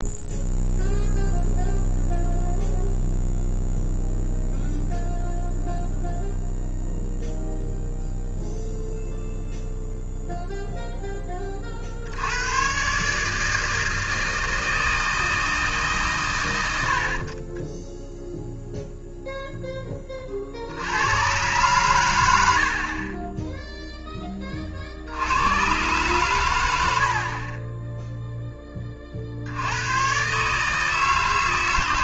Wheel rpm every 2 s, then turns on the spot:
0, 0, 0, 0, 0, 0, 130, 160, 80, 0, 70, 50, 50, 80, 20, 160.
none